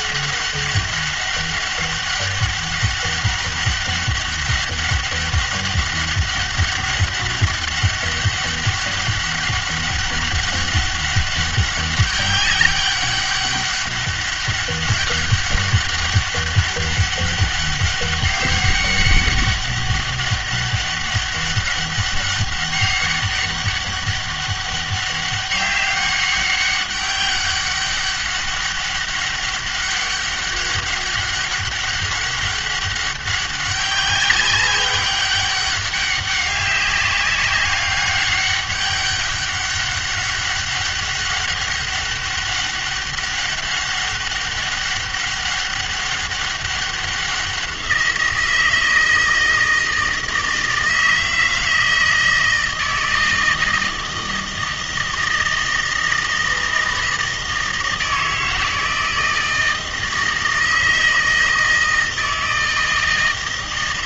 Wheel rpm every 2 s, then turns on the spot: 200, 200, 200, 200, 200, 200, 200, 200, 200, 200, 200, 200, 200, 200, 200, 200, 200, 200, 200, 200, 200, 200, 200, 200, 170, 160, 160, 160, 160, 160, 160, 160.
none